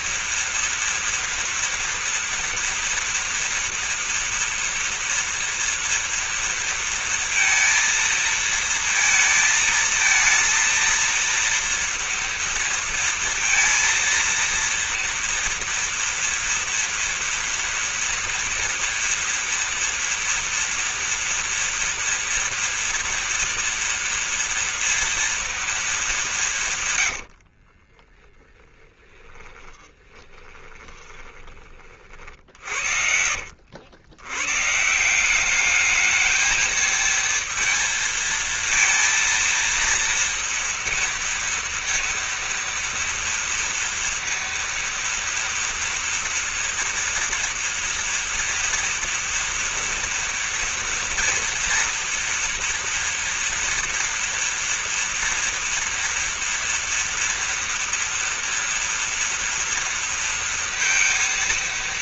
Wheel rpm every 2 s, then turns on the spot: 230, 230, 230, 230, 230, 230, 230, 230, 230, 240, 230, 240, 230, 150, 10, 20, 50, 140, 220, 230, 230, 230, 230, 230, 230, 230, 230, 230, 230, 230, 230.
26-34